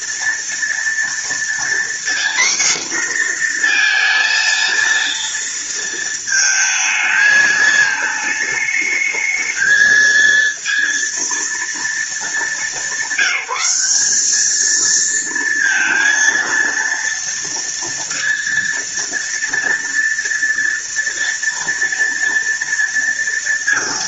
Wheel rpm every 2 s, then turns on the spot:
230, 250, 230, 220, 210, 230, 200, 220, 230, 230, 230, 230.
none